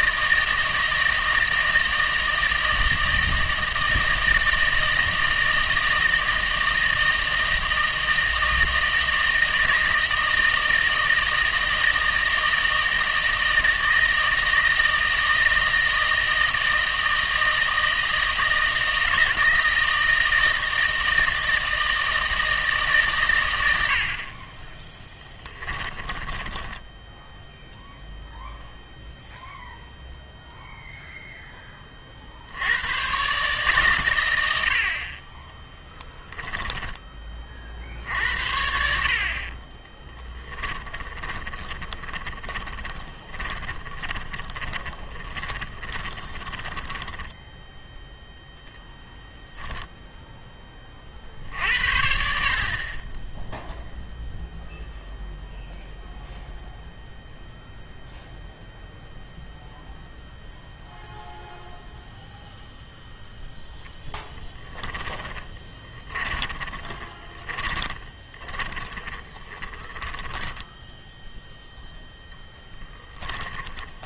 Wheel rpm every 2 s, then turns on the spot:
160, 160, 160, 160, 160, 160, 160, 160, 160, 160, 160, 150, 20, 10, 0, 0, 100, 70, 10, 60, 20, 20, 20, 10, 0, 20, 40, 0, 0, 0, 0, 0, 10, 20, 30, 10, 10.
26-28 36-38 40-48 64-74